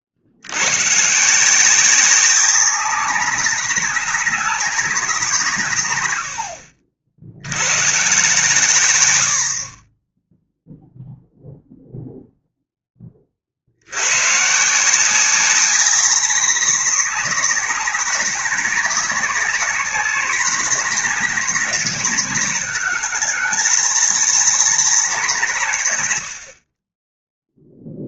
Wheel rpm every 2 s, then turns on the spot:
60, 200, 200, 80, 120, 0, 0, 150, 190, 180, 180, 170, 180, 80.
none